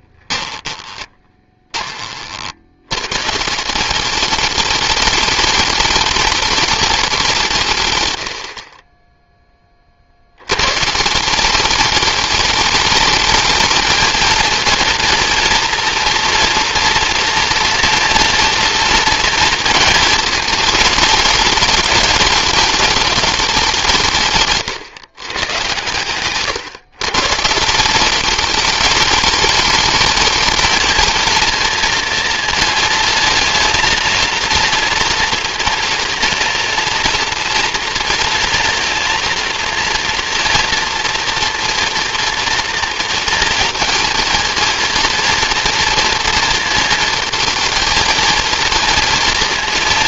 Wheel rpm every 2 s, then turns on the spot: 20, 90, 210, 210, 40, 120, 210, 230, 230, 230, 220, 210, 140, 130, 200, 220, 220, 230, 230, 230, 230, 230, 230, 230, 230.
0-2